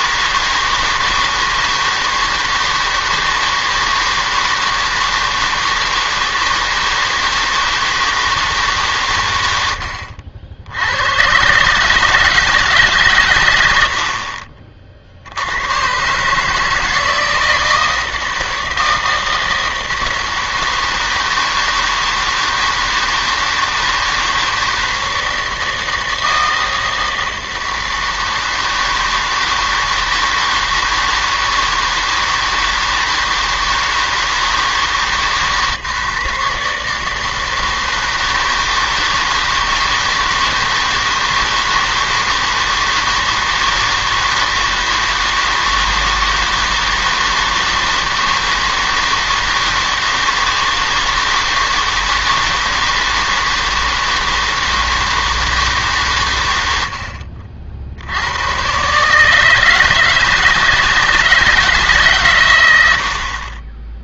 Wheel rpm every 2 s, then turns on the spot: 160, 160, 160, 160, 150, 80, 160, 50, 160, 160, 160, 160, 160, 160, 160, 160, 160, 150, 150, 160, 160, 160, 160, 160, 160, 160, 160, 160, 80, 120, 160, 110.
none